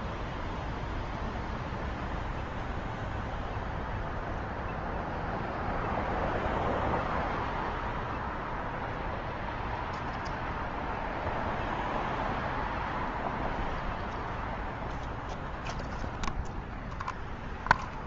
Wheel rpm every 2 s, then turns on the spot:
0, 0, 0, 0, 0, 0, 0, 0, 0.
none